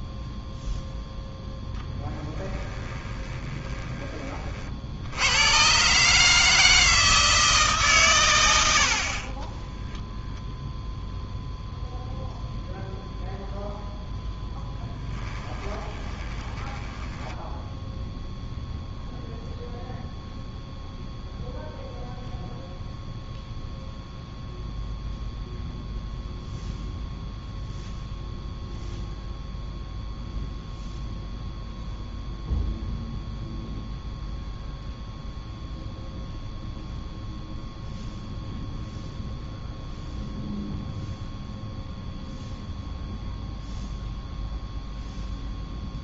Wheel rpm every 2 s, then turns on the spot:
0, 10, 50, 160, 90, 0, 0, 10, 20, 0, 0, 0, 0, 0, 0, 0, 0, 0, 0, 0, 0, 0, 0.
2-4 14-18